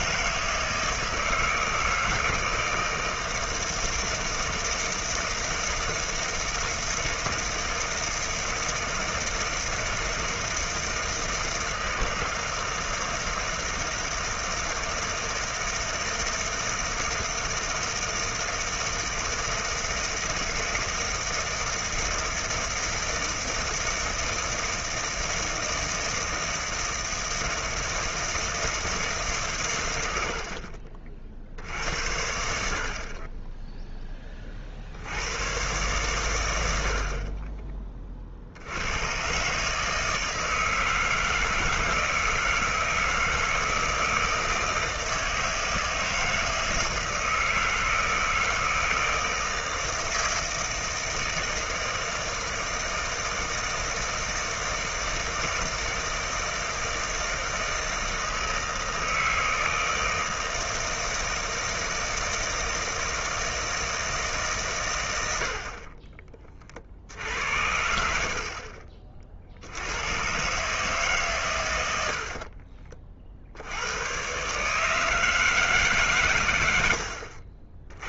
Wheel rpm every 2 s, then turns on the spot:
160, 160, 160, 160, 160, 160, 160, 160, 160, 160, 160, 160, 160, 160, 160, 40, 70, 50, 90, 70, 160, 160, 160, 160, 160, 160, 160, 160, 160, 160, 160, 160, 140, 40, 40, 140, 50, 140, 100.
72-74